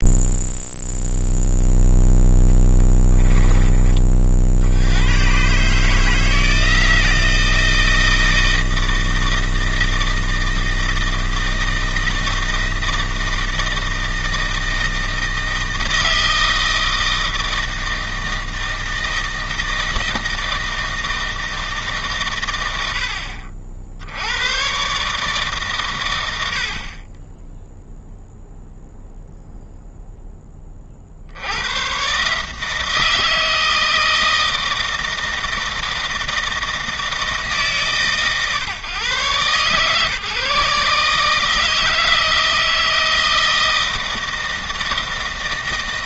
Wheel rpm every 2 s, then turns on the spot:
0, 20, 80, 160, 160, 160, 160, 160, 160, 160, 160, 80, 130, 40, 0, 30, 160, 160, 160, 130, 140, 160, 160.
2-4